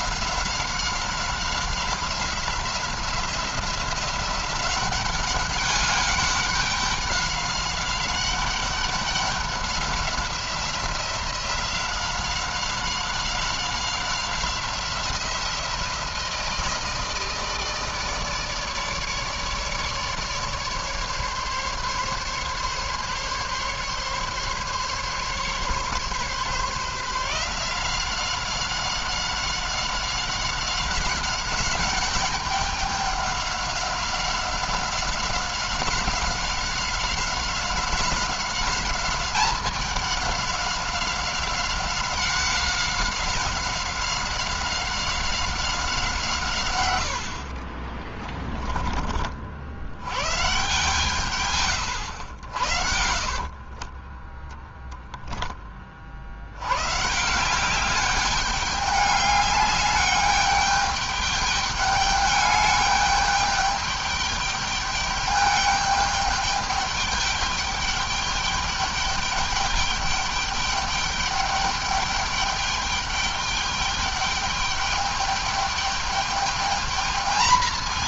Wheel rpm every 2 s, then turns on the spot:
190, 180, 190, 190, 190, 180, 190, 180, 160, 150, 150, 140, 140, 150, 190, 190, 200, 190, 190, 200, 190, 190, 190, 120, 20, 140, 80, 10, 120, 200, 210, 210, 210, 210, 210, 210, 200, 210, 210.
52-54